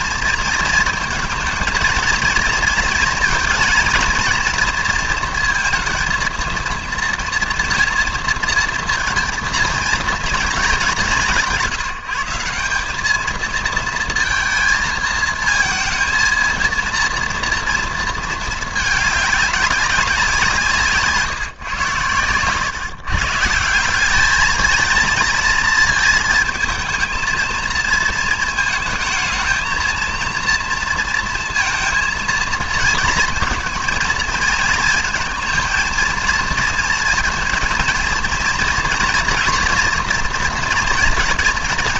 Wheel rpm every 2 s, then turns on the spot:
220, 230, 230, 230, 230, 210, 190, 230, 230, 220, 160, 120, 220, 220, 230, 230, 230, 220, 230, 230, 230.
none